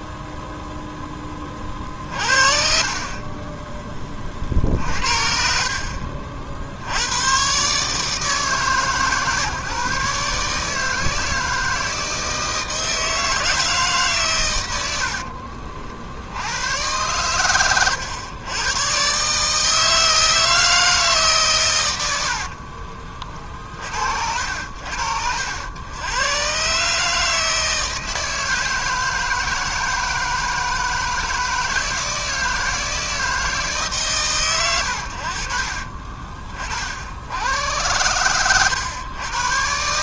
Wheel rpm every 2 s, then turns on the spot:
0, 40, 50, 80, 130, 150, 160, 80, 110, 130, 160, 40, 70, 140, 160, 160, 160, 90, 50, 110.
2-6 22-24